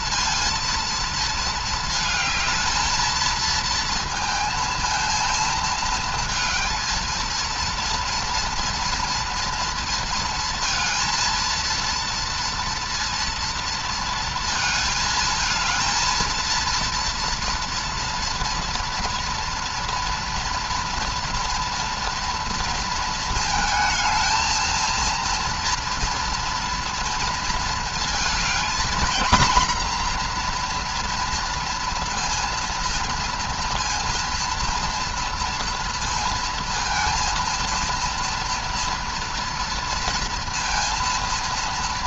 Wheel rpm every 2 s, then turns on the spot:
230, 220, 230, 230, 230, 220, 230, 220, 230, 230, 240, 230, 230, 230, 240, 240, 230, 230, 230, 230, 230.
none